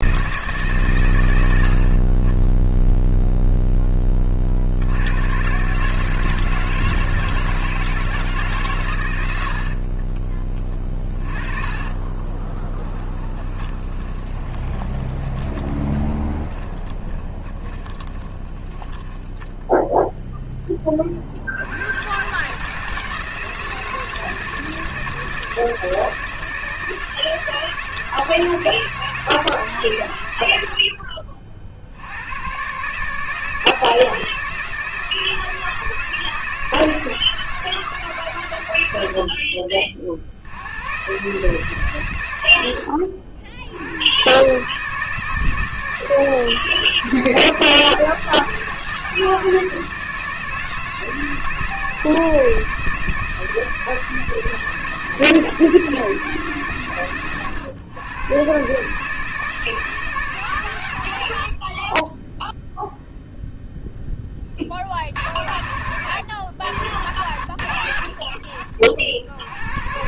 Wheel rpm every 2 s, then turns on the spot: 110, 0, 80, 160, 130, 30, 20, 20, 20, 10, 20, 150, 170, 170, 160, 70, 140, 160, 160, 80, 110, 80, 150, 160, 160, 160, 160, 160, 130, 140, 110, 0, 50, 90, 60.
10-20